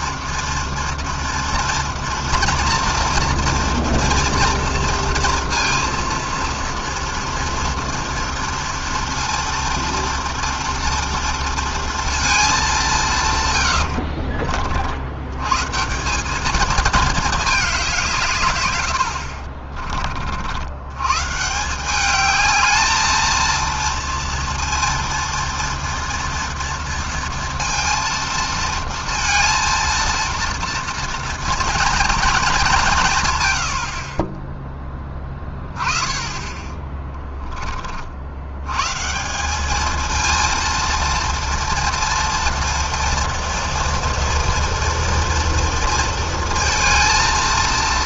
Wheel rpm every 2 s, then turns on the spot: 230, 230, 230, 230, 230, 240, 120, 110, 210, 40, 150, 230, 230, 230, 230, 230, 120, 20, 10, 180, 230, 230, 230, 230.
none